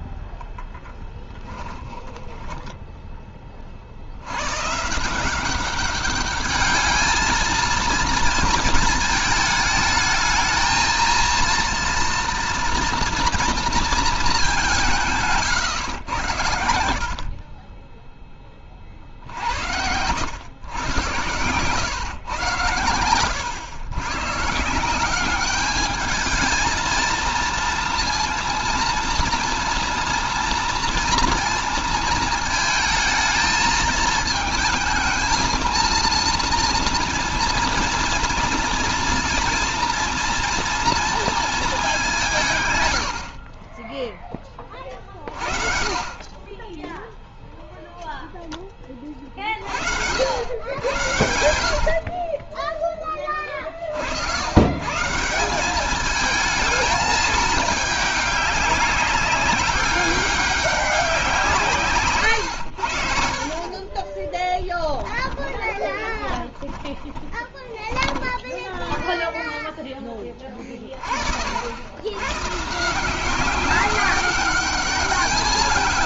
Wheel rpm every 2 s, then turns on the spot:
10, 10, 110, 210, 230, 220, 230, 210, 100, 30, 100, 120, 150, 220, 230, 230, 220, 220, 230, 230, 240, 160, 20, 20, 10, 90, 30, 100, 220, 200, 200, 100, 20, 20, 10, 20, 130, 200.
0-4 64-68